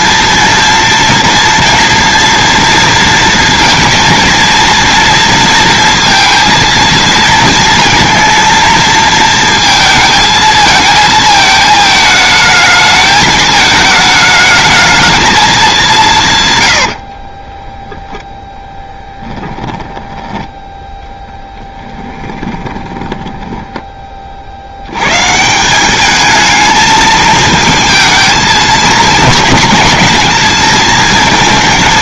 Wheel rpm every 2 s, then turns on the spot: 230, 230, 230, 230, 230, 220, 220, 210, 110, 10, 10, 10, 70, 220, 220, 220.
16-18 22-24